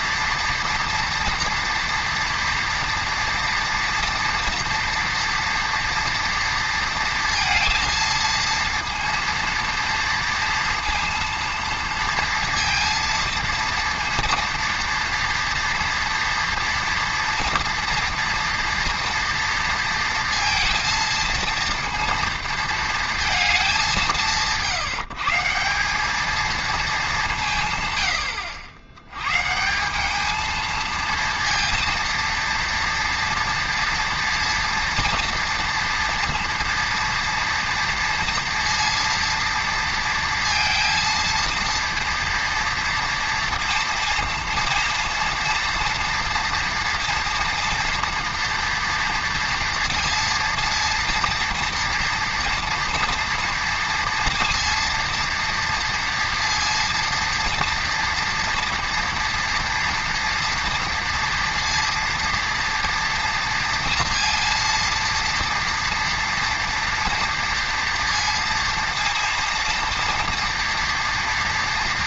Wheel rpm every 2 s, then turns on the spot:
230, 230, 230, 230, 230, 230, 230, 230, 230, 230, 230, 230, 160, 220, 80, 220, 230, 230, 230, 230, 230, 230, 230, 230, 230, 230, 230, 230, 230, 230, 230, 230, 230, 230, 230, 230.
none